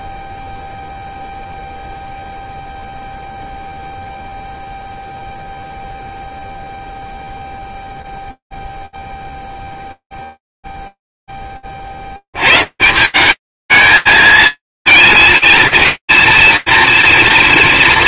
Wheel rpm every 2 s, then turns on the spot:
0, 0, 0, 0, 0, 0, 110, 220, 240.
none